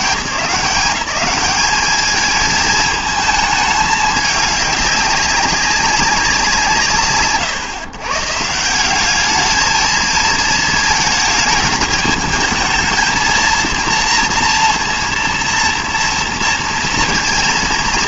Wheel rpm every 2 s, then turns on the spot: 170, 220, 200, 180, 160, 220, 220, 230, 230.
none